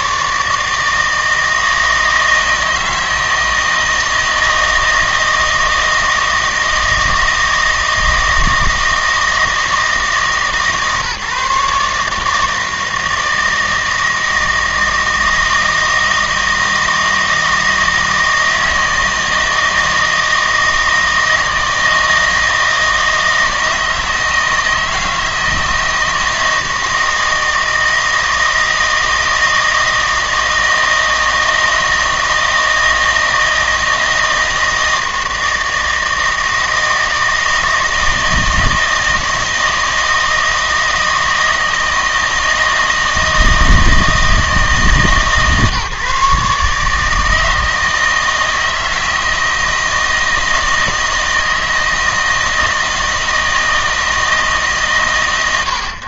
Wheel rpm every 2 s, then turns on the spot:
150, 160, 160, 160, 160, 150, 160, 160, 160, 160, 160, 160, 160, 160, 160, 160, 160, 160, 160, 160, 160, 160, 150, 150, 160, 160, 160, 150.
none